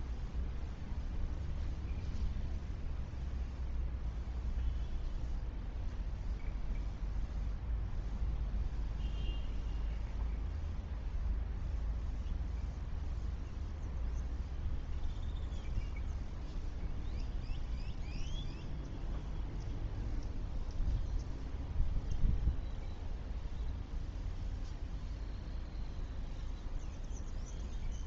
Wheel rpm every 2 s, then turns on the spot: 0, 0, 0, 0, 0, 0, 0, 0, 0, 0, 0, 0, 0, 0.
none